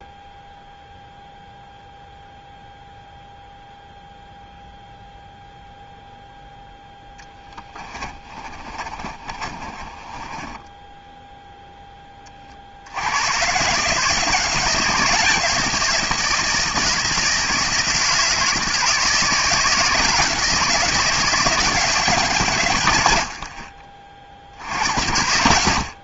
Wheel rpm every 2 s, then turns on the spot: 0, 0, 0, 0, 30, 20, 30, 160, 160, 160, 160, 140, 60.
8-12